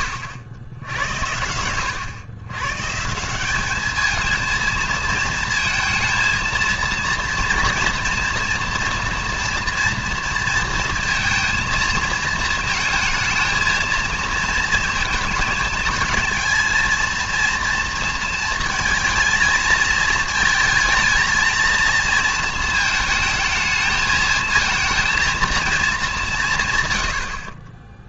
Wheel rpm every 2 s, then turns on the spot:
90, 140, 230, 230, 240, 230, 220, 230, 230, 230, 220, 220, 230, 100.
none